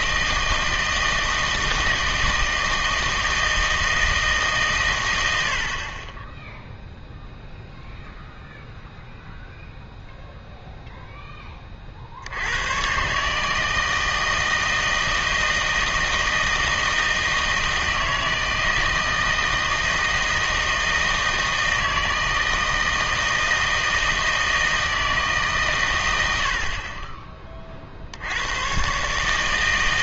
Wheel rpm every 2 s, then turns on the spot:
160, 160, 140, 0, 0, 0, 110, 160, 160, 160, 160, 160, 160, 60, 120.
none